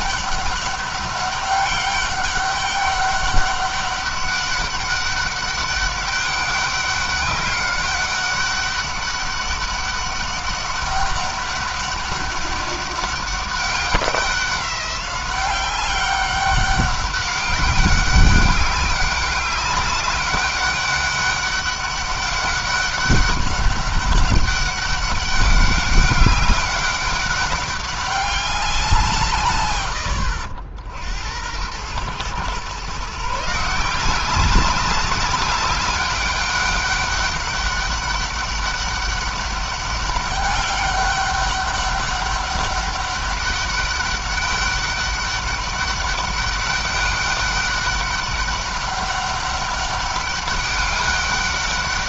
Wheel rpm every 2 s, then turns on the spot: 200, 200, 200, 200, 200, 200, 200, 190, 200, 200, 200, 200, 200, 200, 190, 80, 130, 200, 200, 200, 200, 200, 200, 200, 200, 200.
none